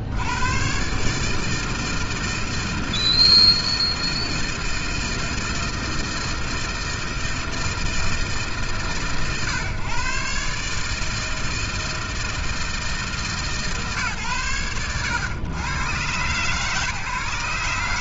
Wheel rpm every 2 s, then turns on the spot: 100, 160, 160, 160, 160, 140, 160, 120, 110.
none